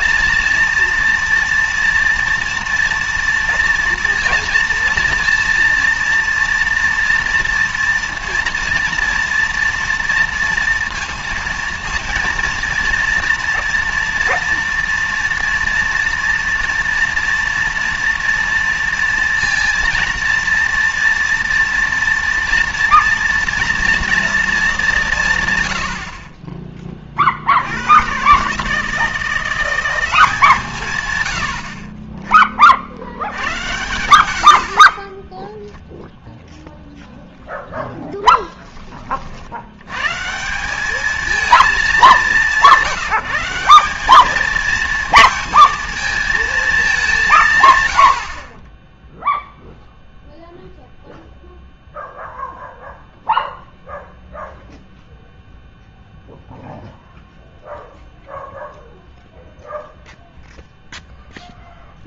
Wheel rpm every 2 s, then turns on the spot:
230, 230, 230, 230, 230, 230, 230, 230, 240, 230, 240, 230, 200, 20, 150, 130, 60, 40, 0, 20, 190, 180, 230, 210, 10, 0, 0, 0, 0, 0, 0.
34-36